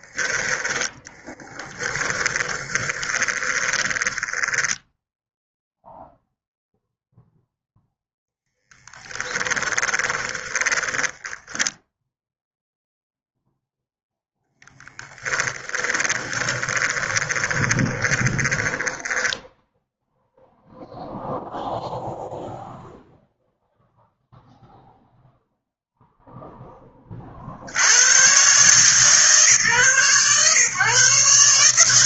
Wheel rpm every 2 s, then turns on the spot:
10, 20, 10, 0, 20, 20, 0, 10, 20, 10, 0, 0, 0, 20, 140, 130.
0-6 8-12 14-20